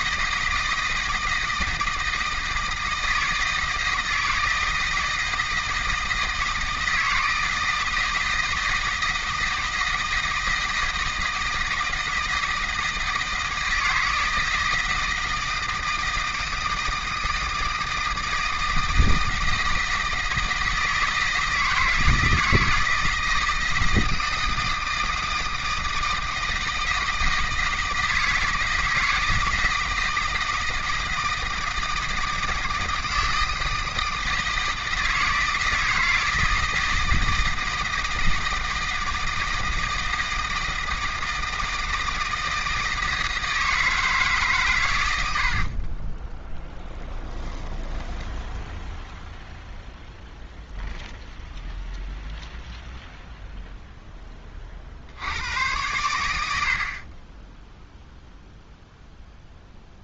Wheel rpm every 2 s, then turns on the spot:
160, 160, 160, 160, 160, 160, 160, 160, 160, 160, 160, 160, 160, 160, 160, 160, 160, 160, 160, 160, 160, 160, 120, 10, 10, 0, 0, 40, 60, 0.
46-48